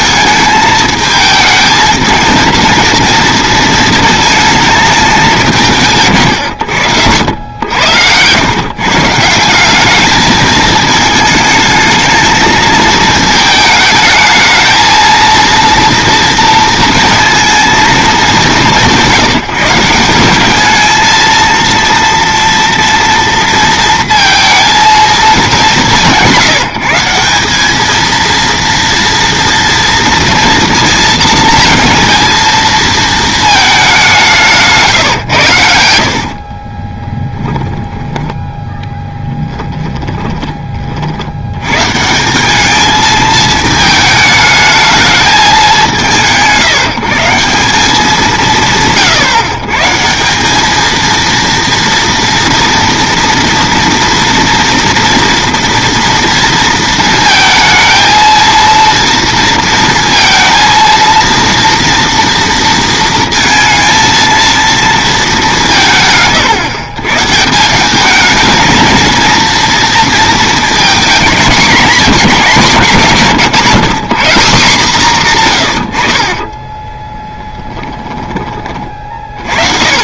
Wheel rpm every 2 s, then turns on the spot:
220, 230, 220, 90, 140, 220, 220, 220, 230, 190, 220, 240, 230, 160, 230, 230, 230, 140, 30, 10, 30, 210, 220, 150, 150, 210, 230, 230, 230, 230, 230, 230, 230, 130, 220, 220, 170, 160, 10, 50.
6-8 34-38 76-78